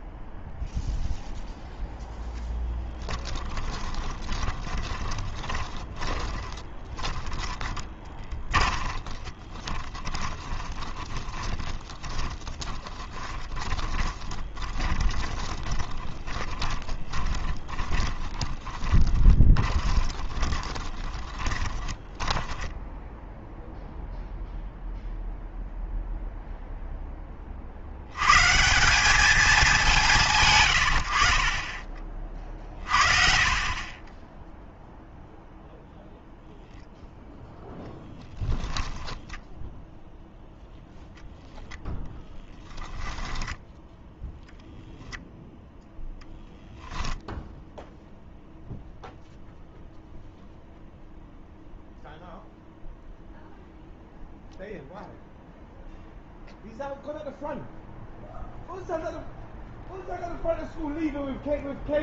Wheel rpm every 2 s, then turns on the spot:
0, 0, 10, 20, 30, 20, 20, 20, 20, 20, 20, 10, 0, 0, 170, 120, 40, 0, 0, 10, 0, 10, 10, 0, 0, 0, 0, 0, 0, 0, 0.
4-24 32-34